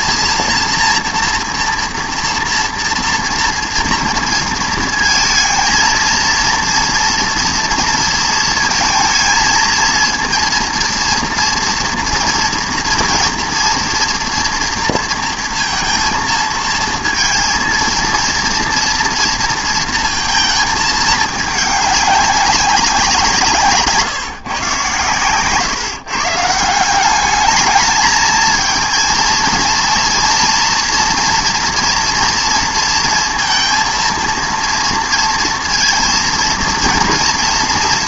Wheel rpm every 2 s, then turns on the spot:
230, 230, 230, 230, 220, 230, 230, 230, 230, 230, 220, 200, 140, 150, 220, 230, 230, 230, 240.
none